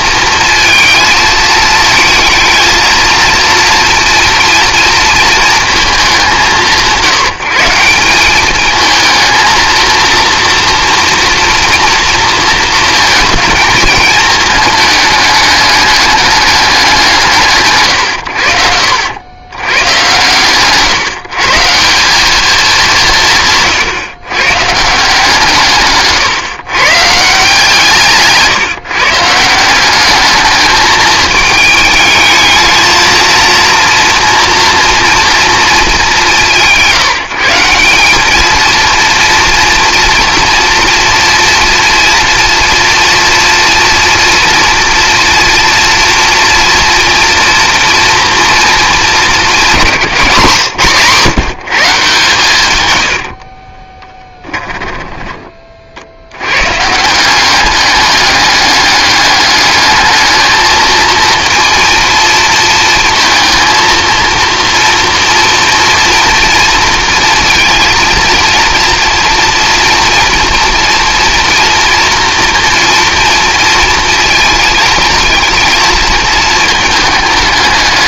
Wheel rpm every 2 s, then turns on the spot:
220, 230, 230, 160, 220, 230, 230, 210, 190, 90, 140, 190, 150, 140, 160, 220, 220, 230, 170, 230, 230, 240, 240, 230, 220, 150, 110, 10, 130, 200, 220, 230, 230, 230, 230, 230, 230, 220, 210.
52-56